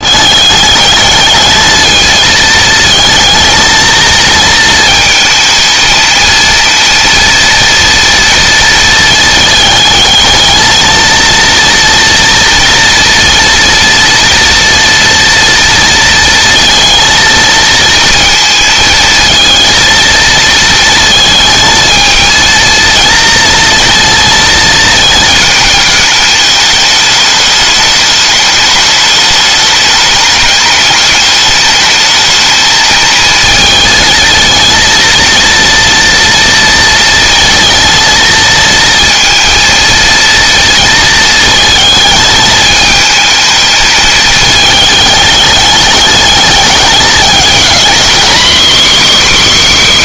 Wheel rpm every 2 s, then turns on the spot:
220, 220, 220, 230, 230, 230, 230, 230, 230, 230, 220, 230, 220, 210, 210, 210, 220, 230, 230, 230, 220, 220, 210, 210, 280.
none